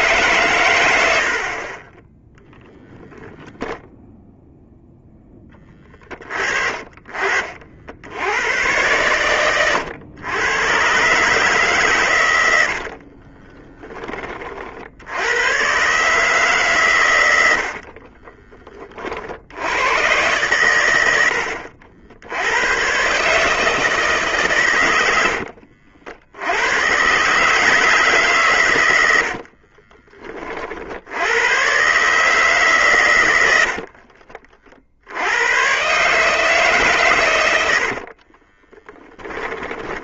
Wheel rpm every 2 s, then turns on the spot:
90, 0, 10, 40, 110, 130, 70, 90, 110, 40, 100, 130, 100, 130, 90, 70, 120, 70, 130, 10.
6-8 12-14 38-40